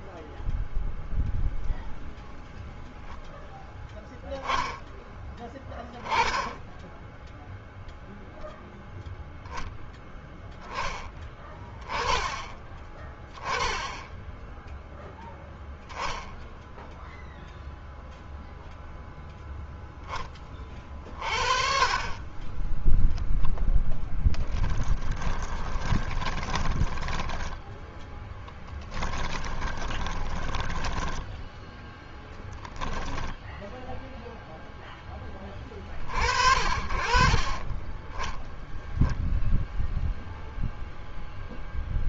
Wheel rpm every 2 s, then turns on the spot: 0, 0, 10, 10, 0, 10, 10, 10, 0, 0, 30, 10, 20, 10, 10, 10, 0, 10, 40, 0, 0.
24-32